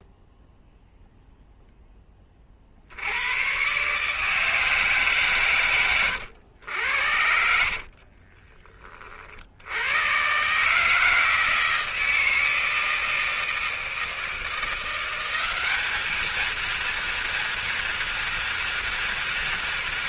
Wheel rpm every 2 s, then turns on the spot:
0, 30, 150, 100, 40, 120, 160, 160, 220, 230.
6-10